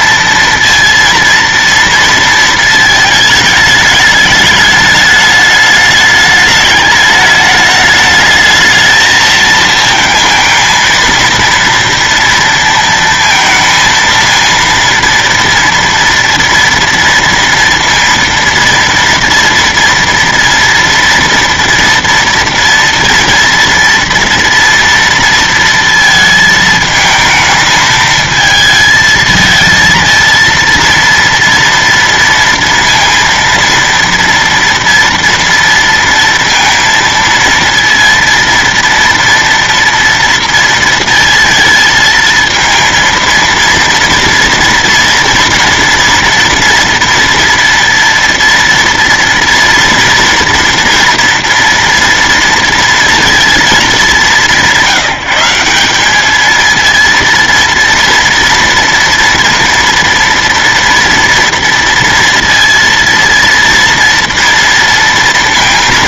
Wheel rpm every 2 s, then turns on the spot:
230, 230, 210, 210, 220, 220, 230, 230, 230, 230, 230, 230, 230, 220, 220, 230, 230, 230, 230, 230, 230, 230, 230, 230, 230, 230, 230, 190, 220, 230, 230, 230, 230.
none